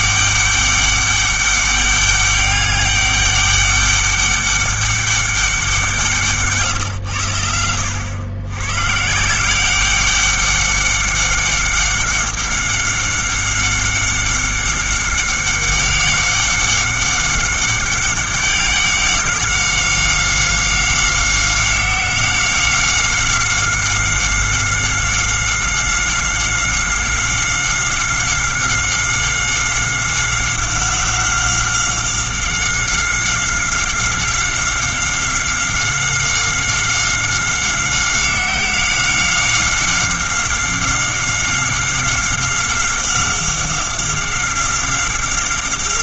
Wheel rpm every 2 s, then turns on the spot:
200, 200, 200, 130, 120, 200, 190, 190, 190, 190, 190, 190, 190, 190, 190, 190, 190, 190, 190, 190, 190, 190, 190.
6-8